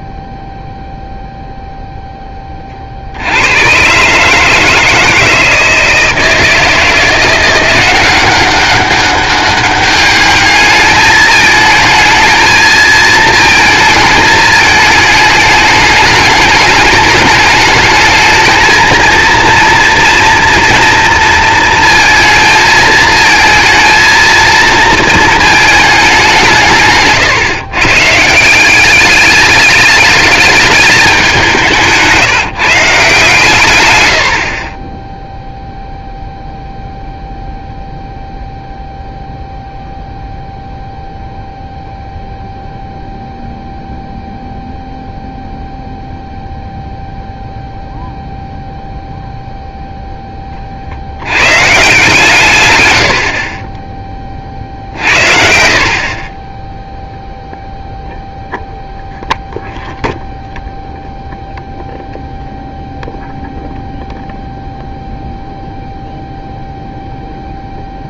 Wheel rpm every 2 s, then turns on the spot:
0, 30, 160, 160, 190, 210, 220, 210, 210, 220, 230, 220, 220, 160, 180, 210, 150, 30, 0, 0, 0, 0, 0, 0, 0, 40, 120, 50, 10, 0, 0, 0, 0, 0.
34-36